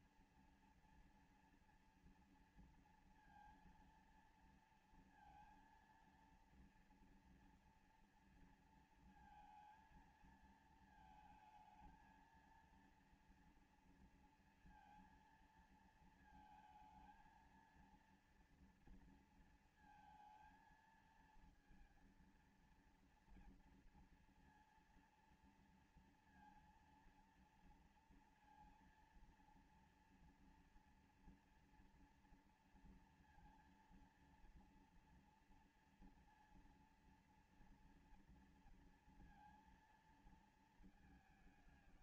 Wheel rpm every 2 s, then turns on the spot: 240, 230, 230, 230, 230, 220, 230, 230, 220, 230, 230, 230, 230, 230, 230, 230, 230, 230, 230, 230, 220.
none